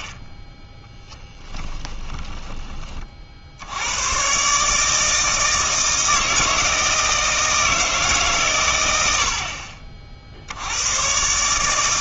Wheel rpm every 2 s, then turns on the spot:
10, 30, 150, 160, 100, 100.
none